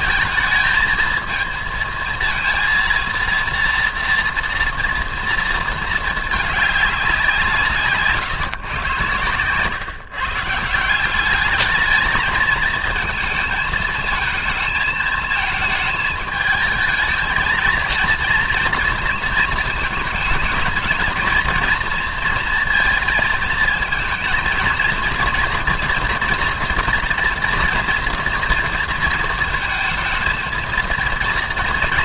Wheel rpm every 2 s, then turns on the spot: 220, 230, 240, 210, 130, 150, 220, 220, 220, 230, 220, 230, 230, 240, 230, 230.
none